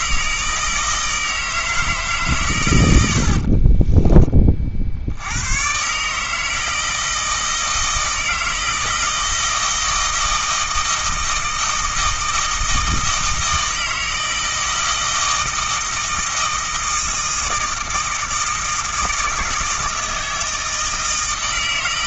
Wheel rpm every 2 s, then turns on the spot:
160, 100, 60, 160, 160, 160, 160, 160, 160, 160, 160.
none